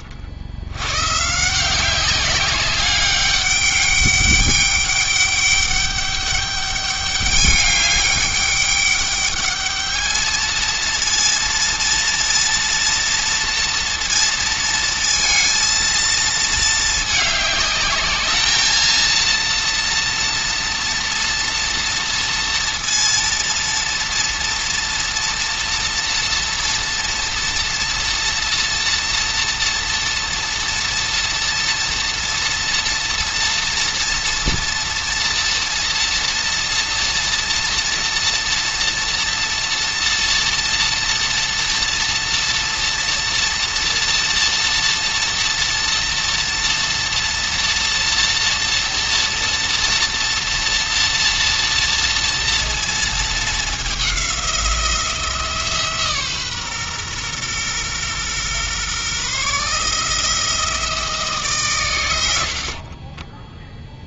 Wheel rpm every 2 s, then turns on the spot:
100, 200, 200, 200, 200, 230, 230, 230, 220, 230, 230, 230, 230, 240, 240, 230, 230, 230, 240, 230, 230, 240, 230, 230, 230, 230, 230, 170, 130, 130, 160, 50.
62-64